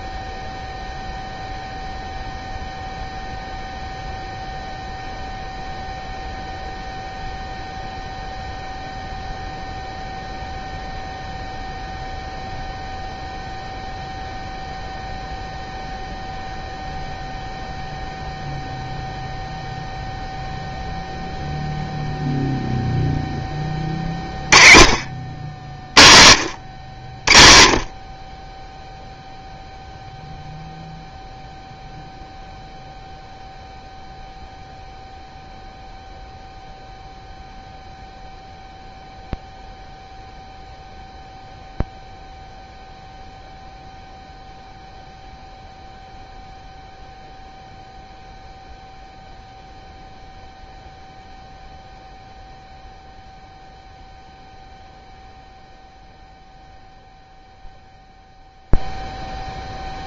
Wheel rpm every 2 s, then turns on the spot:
0, 0, 0, 0, 0, 0, 0, 0, 0, 0, 0, 0, 40, 100, 10, 0, 0, 0, 0, 0, 0, 0, 0, 0, 0, 0, 0, 0, 0, 0.
none